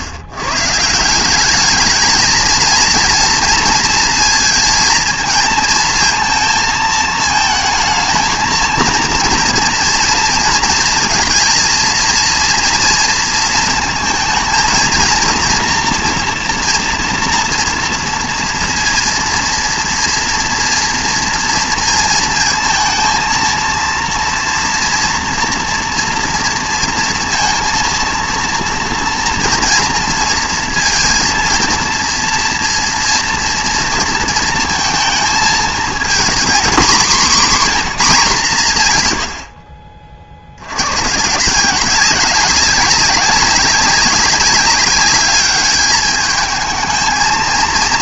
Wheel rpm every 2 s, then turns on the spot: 140, 230, 230, 230, 230, 230, 230, 230, 230, 230, 230, 220, 230, 230, 230, 230, 230, 230, 230, 160, 70, 190, 200, 220.
none